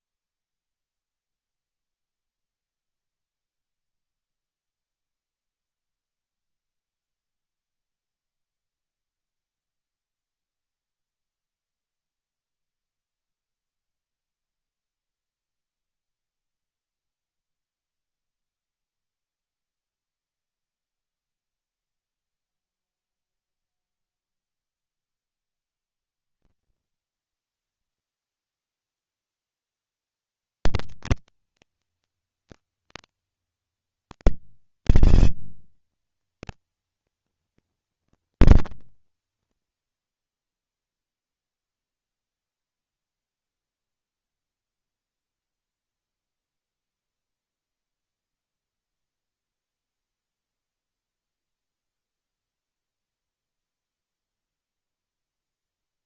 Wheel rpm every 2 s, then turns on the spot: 0, 0, 0, 0, 0, 0, 0, 0, 0, 0, 0, 0, 20, 200, 230, 230, 220, 200, 230, 110, 0, 0, 0, 0, 0, 0, 0, 10.
none